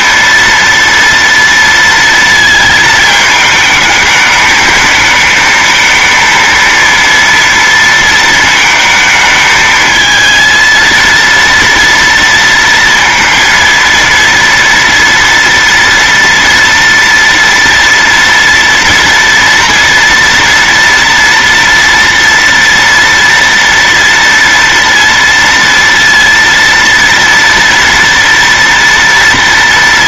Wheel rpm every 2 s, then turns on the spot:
230, 220, 220, 230, 220, 230, 230, 230, 230, 230, 230, 230, 230, 230, 230.
none